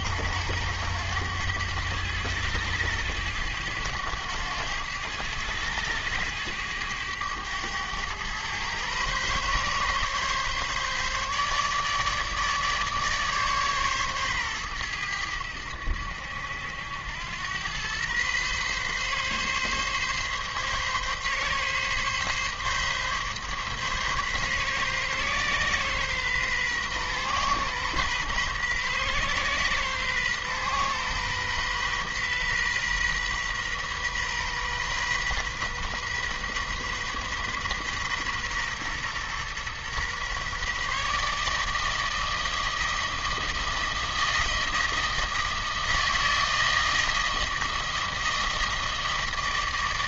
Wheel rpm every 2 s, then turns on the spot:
100, 100, 100, 100, 130, 140, 150, 100, 80, 130, 140, 140, 130, 130, 130, 130, 130, 130, 130, 120, 140, 160, 160, 160, 160.
none